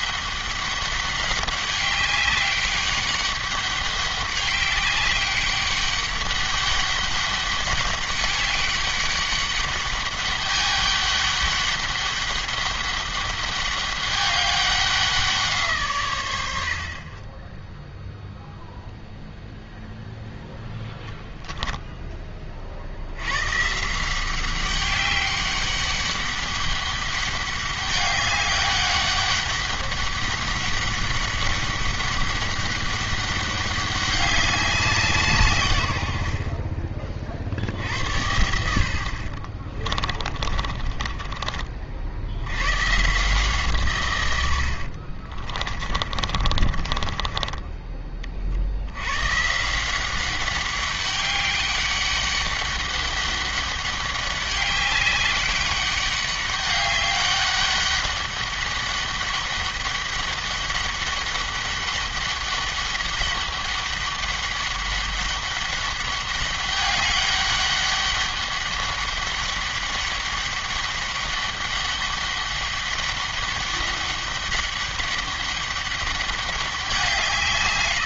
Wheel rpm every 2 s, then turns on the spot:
200, 200, 200, 200, 200, 200, 200, 190, 60, 0, 0, 50, 190, 200, 200, 200, 200, 190, 50, 70, 40, 120, 70, 30, 70, 200, 200, 200, 200, 200, 200, 200, 200, 200, 200, 200, 200, 200, 190.
40-42 44-48